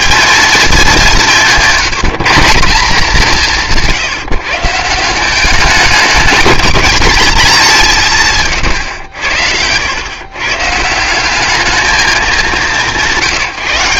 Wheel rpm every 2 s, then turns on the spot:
220, 190, 150, 220, 120, 140, 190.
none